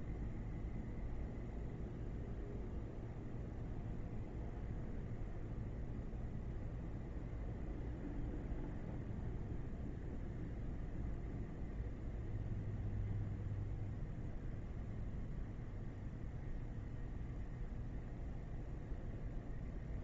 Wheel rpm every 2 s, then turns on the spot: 0, 0, 0, 0, 0, 0, 0, 0, 0, 0.
none